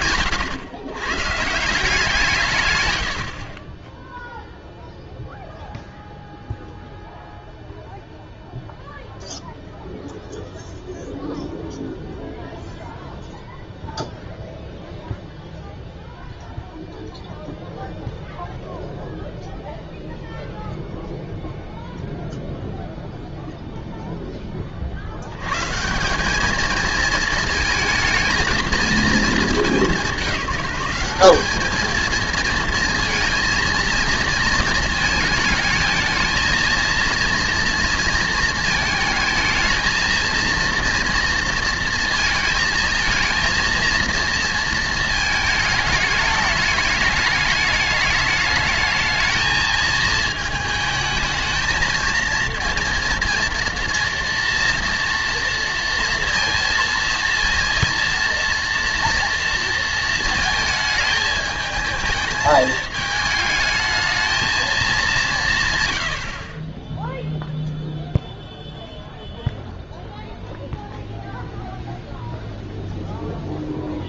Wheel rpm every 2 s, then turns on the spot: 130, 110, 0, 0, 0, 0, 0, 0, 0, 0, 0, 0, 40, 220, 220, 190, 230, 230, 230, 220, 230, 220, 230, 210, 220, 220, 230, 230, 230, 230, 220, 220, 210, 20, 0, 0, 0.
none